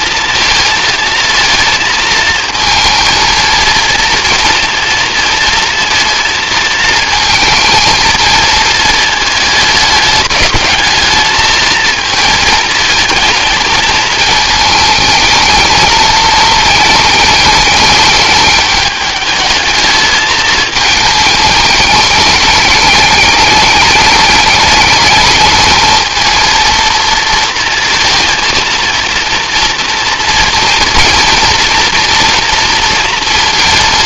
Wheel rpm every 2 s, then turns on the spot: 230, 220, 230, 230, 220, 220, 220, 220, 220, 210, 220, 210, 210, 230, 230, 230, 230.
none